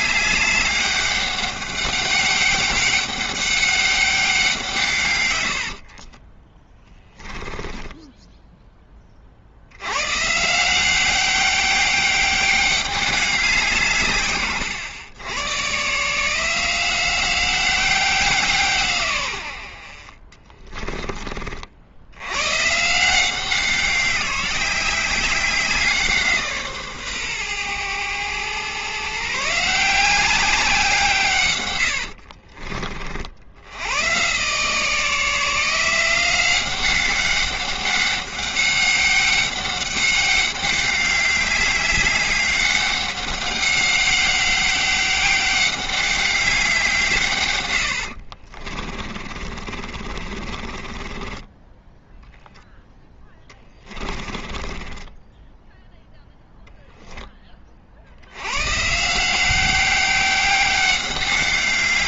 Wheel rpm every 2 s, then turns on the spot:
200, 200, 160, 10, 10, 170, 200, 110, 170, 160, 20, 130, 190, 150, 120, 180, 40, 150, 180, 200, 200, 200, 200, 190, 40, 30, 10, 20, 0, 130, 190.
6-8 20-22 48-52 54-56